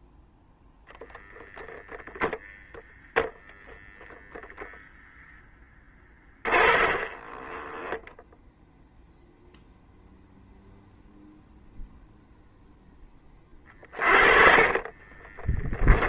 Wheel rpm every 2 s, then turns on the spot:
0, 0, 0, 30, 0, 0, 10, 30.
6-8 14-16